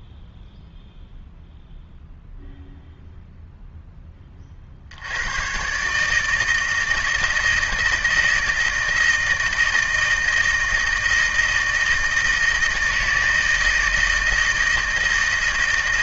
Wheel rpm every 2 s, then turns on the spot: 0, 0, 50, 160, 160, 160, 160, 160.
none